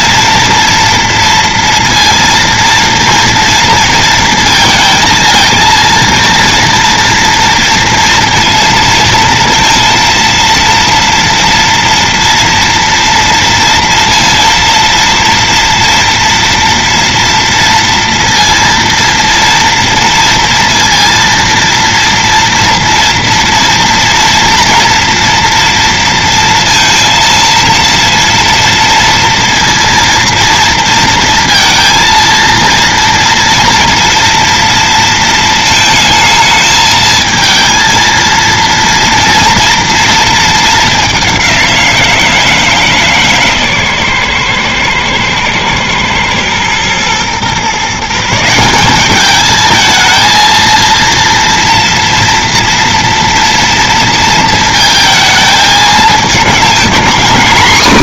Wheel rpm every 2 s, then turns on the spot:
230, 230, 230, 230, 230, 230, 230, 230, 230, 230, 230, 230, 230, 230, 230, 230, 230, 230, 220, 230, 210, 160, 120, 120, 180, 230, 230, 230, 220.
none